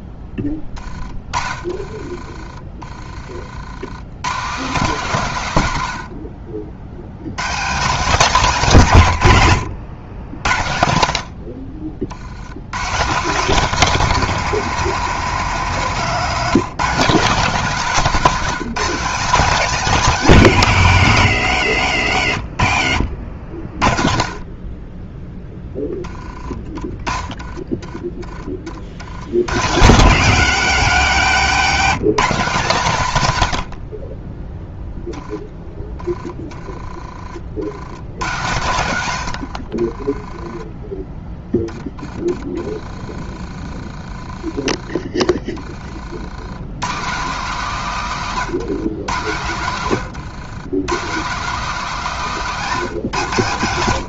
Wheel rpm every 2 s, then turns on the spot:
30, 30, 180, 90, 170, 60, 150, 210, 220, 210, 140, 60, 20, 20, 60, 190, 170, 10, 20, 70, 10, 20, 20, 140, 130, 150, 150.
0-2 22-24 48-50